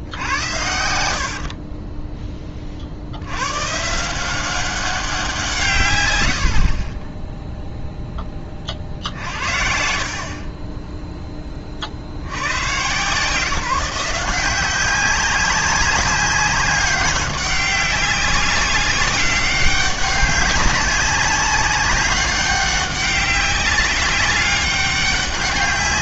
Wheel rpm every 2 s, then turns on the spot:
80, 40, 190, 50, 40, 20, 110, 180, 200, 190, 190, 190, 200.
0-2 6-8 10-12